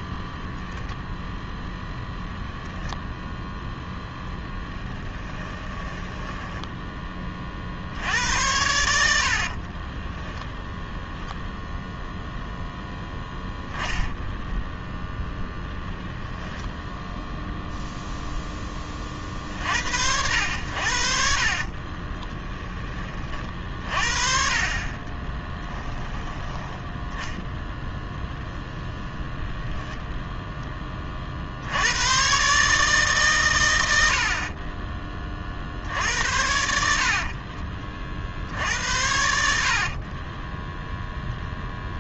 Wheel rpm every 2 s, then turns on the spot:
0, 0, 10, 10, 90, 0, 0, 0, 10, 10, 80, 10, 40, 10, 10, 10, 140, 40, 70, 70, 10.
6-8 16-18 34-36 40-42